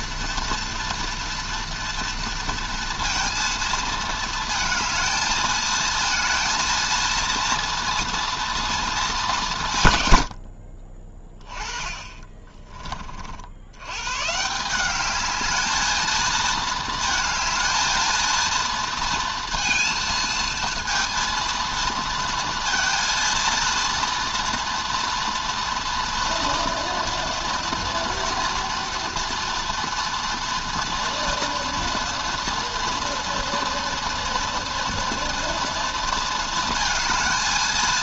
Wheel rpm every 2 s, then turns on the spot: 230, 230, 220, 230, 210, 30, 40, 200, 220, 230, 230, 230, 230, 230, 230, 230, 230, 240, 220.
10-12